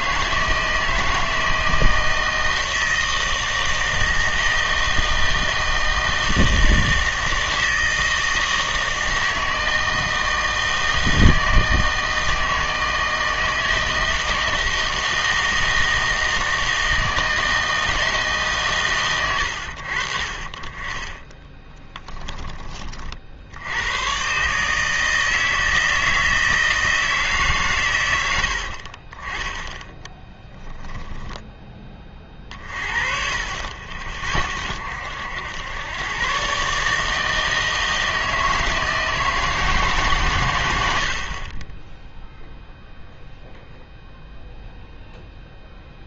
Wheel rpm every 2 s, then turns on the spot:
160, 160, 160, 160, 160, 160, 160, 160, 160, 140, 30, 20, 150, 160, 60, 10, 30, 60, 140, 160, 100, 0, 0.
30-32